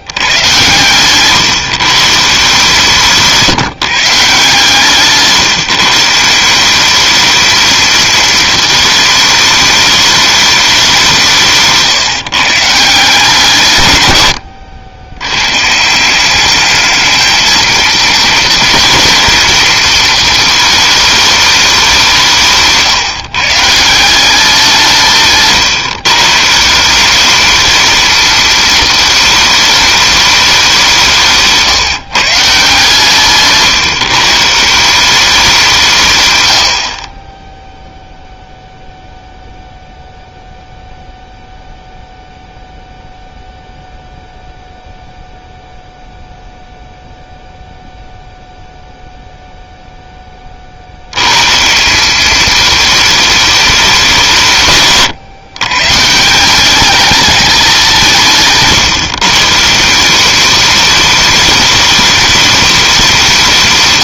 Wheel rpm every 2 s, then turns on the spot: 130, 150, 160, 190, 220, 200, 160, 80, 210, 230, 220, 160, 180, 170, 220, 190, 150, 160, 70, 0, 0, 0, 0, 0, 0, 60, 220, 140, 190, 160, 200, 200.
58-60